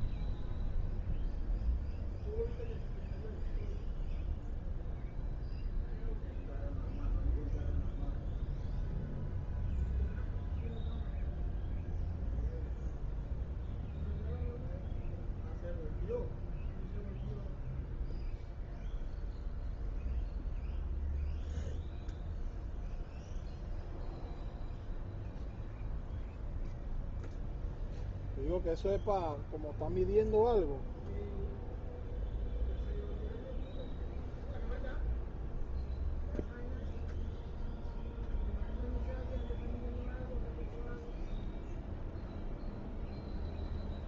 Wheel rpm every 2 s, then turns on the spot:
0, 0, 0, 0, 0, 0, 0, 0, 0, 0, 0, 0, 0, 0, 0, 0, 0, 0, 0, 0, 0, 0.
none